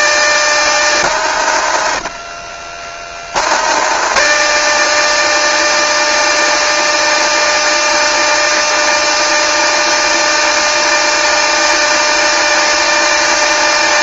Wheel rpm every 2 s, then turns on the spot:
160, 170, 160, 160, 160, 170, 160.
none